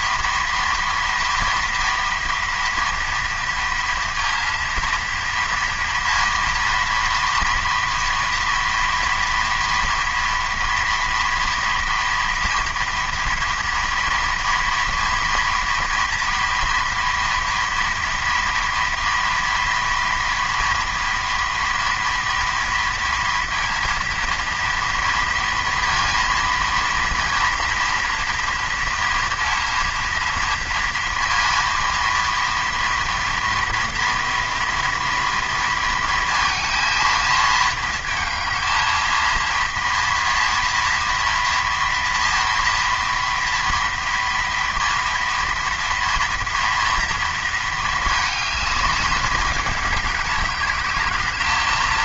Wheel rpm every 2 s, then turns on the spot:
240, 230, 230, 240, 230, 230, 240, 230, 230, 230, 230, 230, 230, 230, 230, 230, 230, 240, 230, 220, 230, 230, 230, 230, 210, 200.
none